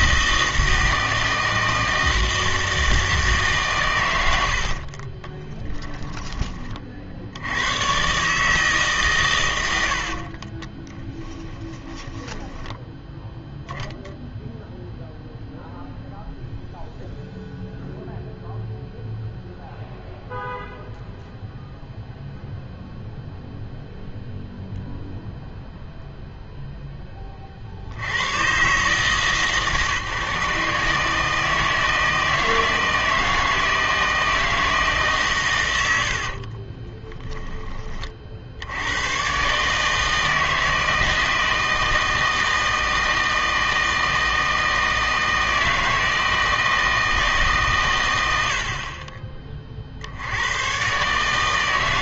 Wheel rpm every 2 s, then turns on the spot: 160, 160, 60, 40, 160, 30, 10, 0, 0, 0, 0, 0, 0, 10, 140, 150, 160, 160, 20, 80, 160, 160, 160, 160, 50, 120.
4-6 10-12 36-38